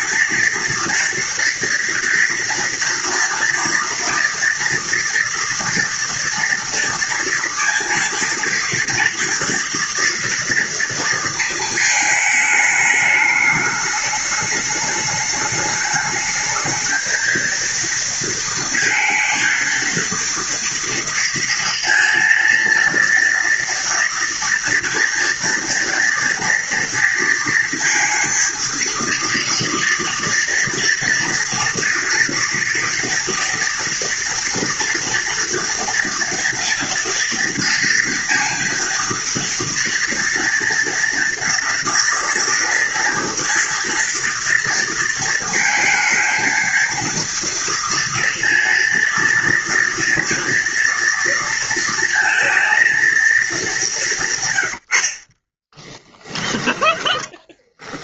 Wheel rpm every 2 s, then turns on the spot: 230, 230, 240, 230, 230, 230, 210, 210, 220, 230, 230, 230, 230, 230, 230, 230, 230, 230, 230, 230, 240, 230, 230, 230, 230, 230, 230, 120, 10.
54-56